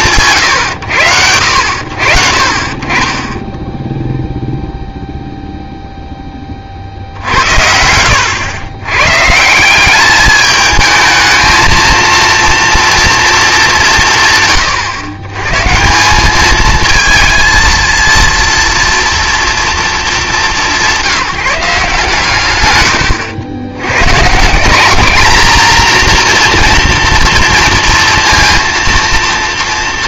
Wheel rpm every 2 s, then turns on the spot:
130, 50, 0, 40, 100, 210, 230, 130, 220, 230, 200, 120, 200, 240, 230.
none